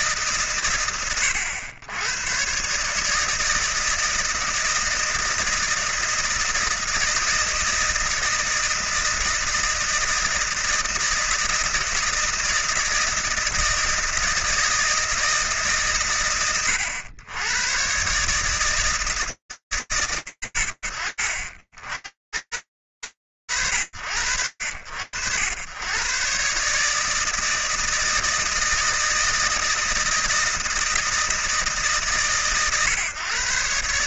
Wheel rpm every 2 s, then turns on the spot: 90, 160, 160, 160, 160, 160, 160, 130, 130, 90, 50, 70, 130, 160, 160, 140, 160.
none